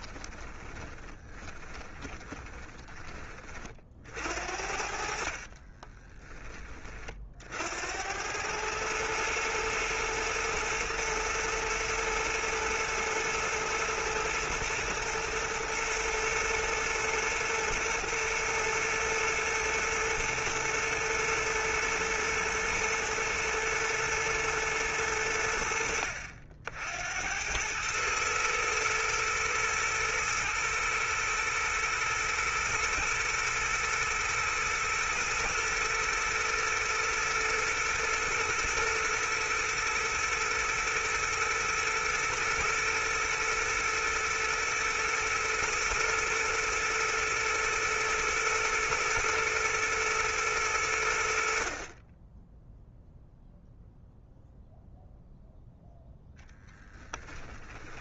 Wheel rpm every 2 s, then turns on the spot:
20, 40, 60, 20, 110, 110, 110, 110, 110, 110, 120, 110, 100, 70, 110, 110, 120, 110, 120, 110, 110, 120, 120, 120, 120, 90, 0, 0, 10.
0-4 56-58